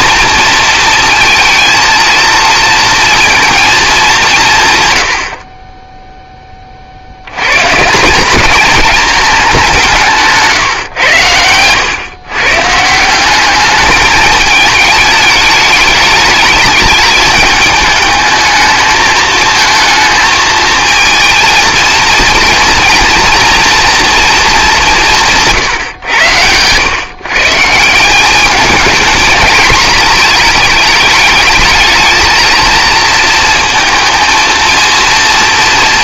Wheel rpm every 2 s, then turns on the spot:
230, 230, 140, 30, 210, 150, 150, 210, 210, 220, 220, 230, 200, 110, 210, 220, 220, 230.
none